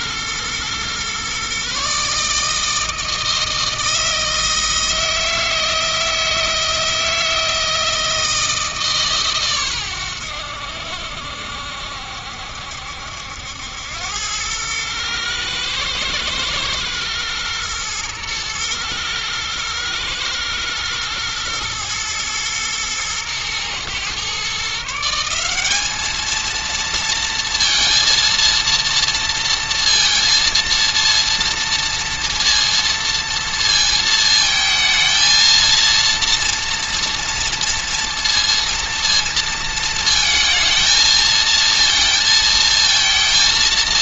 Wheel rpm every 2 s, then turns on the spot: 120, 160, 160, 160, 160, 70, 70, 110, 110, 110, 110, 110, 150, 230, 230, 230, 230, 220, 240, 230, 220, 230.
none